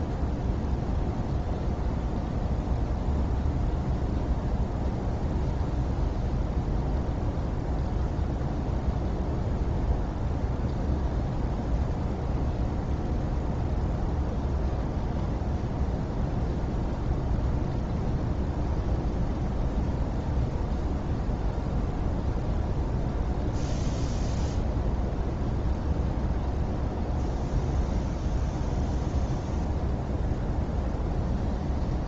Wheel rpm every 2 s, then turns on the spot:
0, 0, 0, 0, 0, 0, 0, 0, 0, 0, 0, 0, 0, 0, 0, 0.
none